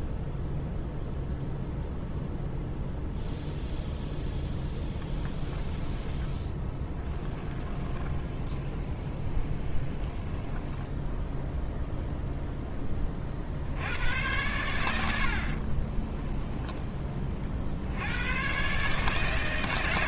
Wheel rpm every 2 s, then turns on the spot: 0, 0, 10, 10, 20, 10, 20, 80, 20, 130.
4-12